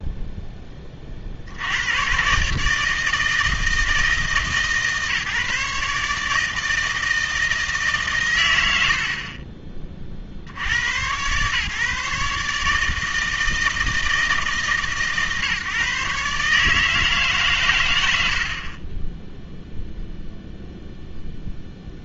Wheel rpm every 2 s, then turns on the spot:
10, 140, 150, 160, 90, 90, 150, 150, 150, 40, 0.
none